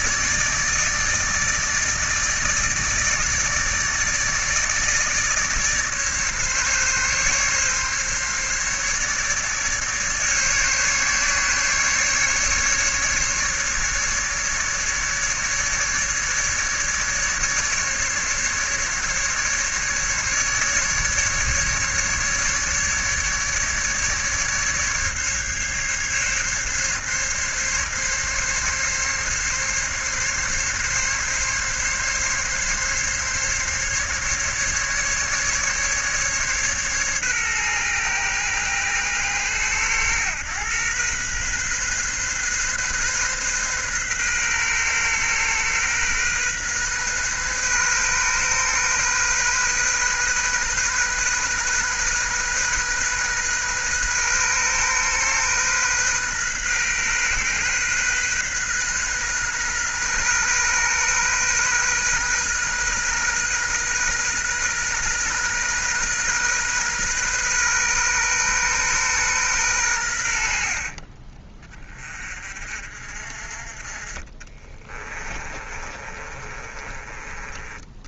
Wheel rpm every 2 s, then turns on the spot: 150, 160, 150, 140, 150, 140, 150, 150, 140, 150, 150, 150, 140, 140, 140, 140, 140, 140, 130, 110, 110, 130, 130, 130, 130, 130, 130, 130, 130, 130, 130, 130, 130, 130, 130, 50, 50, 30, 30.
70-72 74-78